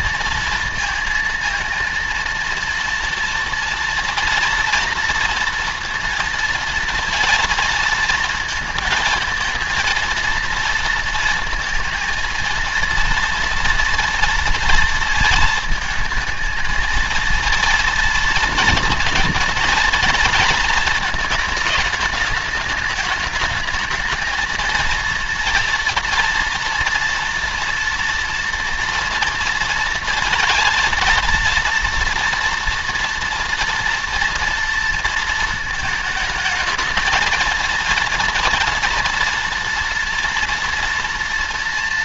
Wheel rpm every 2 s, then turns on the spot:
230, 230, 230, 230, 230, 230, 230, 230, 220, 230, 230, 210, 230, 240, 230, 230, 230, 230, 220, 230, 230.
none